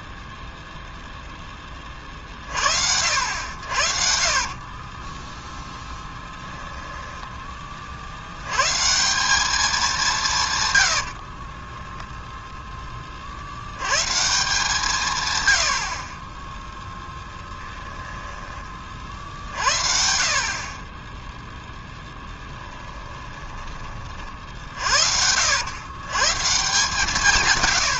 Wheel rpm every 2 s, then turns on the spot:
0, 60, 30, 10, 160, 90, 10, 160, 10, 30, 20, 10, 50, 160.
4-8 10-12 16-18 22-26